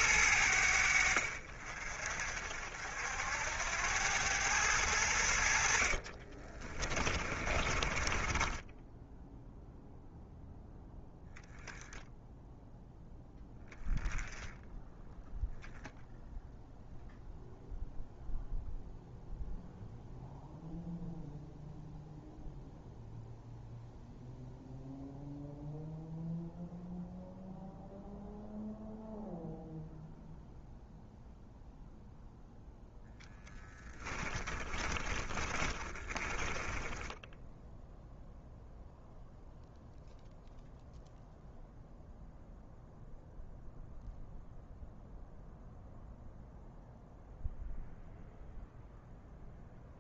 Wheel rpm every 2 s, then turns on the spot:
70, 70, 90, 30, 10, 10, 0, 0, 0, 0, 0, 0, 0, 0, 0, 0, 0, 20, 10, 0, 0, 0, 0, 0, 0.
6-10 34-38